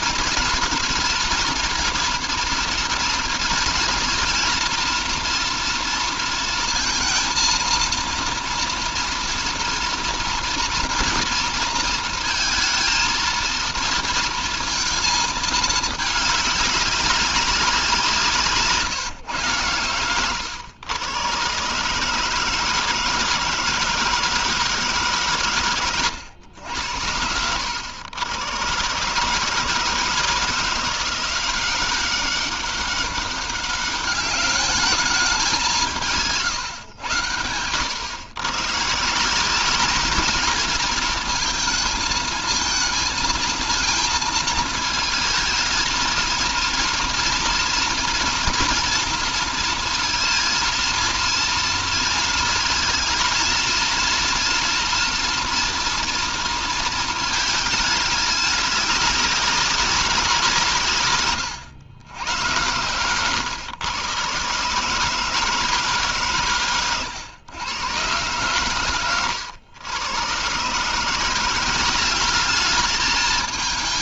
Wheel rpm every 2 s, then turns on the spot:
230, 220, 230, 230, 230, 230, 230, 230, 200, 140, 120, 160, 150, 80, 140, 170, 200, 210, 110, 150, 220, 230, 230, 230, 230, 230, 230, 240, 220, 200, 130, 110, 160, 110, 100, 170, 220.
none